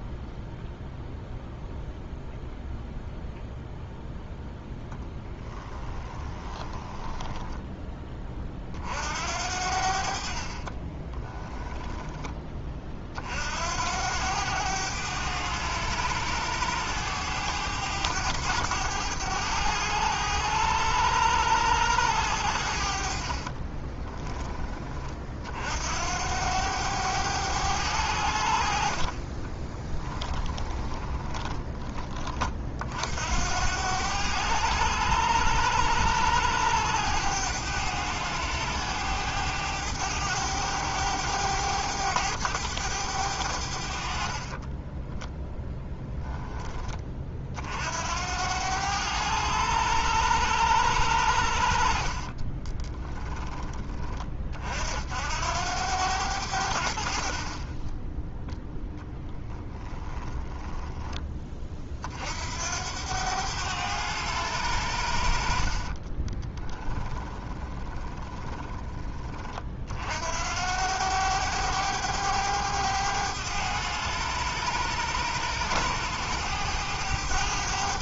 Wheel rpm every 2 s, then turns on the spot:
0, 0, 0, 20, 50, 30, 40, 100, 100, 100, 100, 50, 20, 100, 50, 10, 50, 100, 100, 100, 100, 100, 10, 20, 100, 90, 20, 60, 60, 10, 10, 90, 80, 10, 20, 90, 100, 100, 100.
6-8 10-12 22-24 30-32 44-46 52-54 60-62 66-68